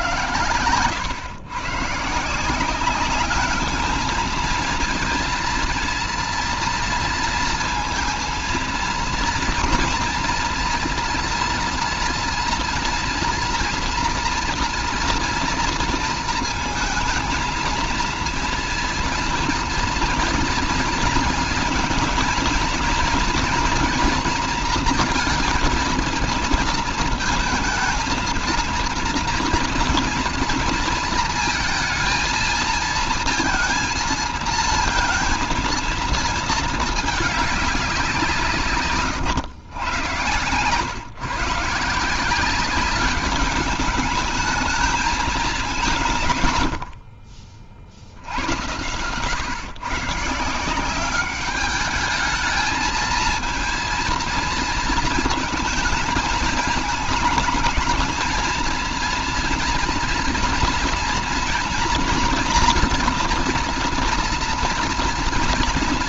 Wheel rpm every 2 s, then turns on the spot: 120, 160, 230, 230, 230, 230, 230, 230, 230, 230, 230, 220, 230, 220, 230, 230, 230, 230, 230, 160, 110, 180, 210, 130, 70, 150, 210, 230, 210, 230, 230, 230, 230.
none